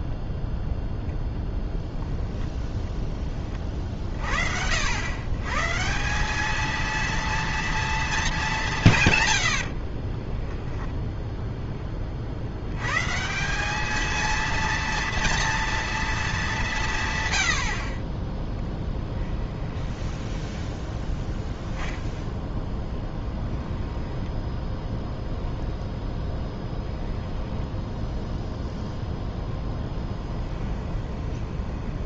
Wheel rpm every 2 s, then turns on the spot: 0, 10, 60, 220, 180, 10, 80, 230, 200, 10, 10, 0, 10, 0, 0, 10.
10-12 18-20 30-32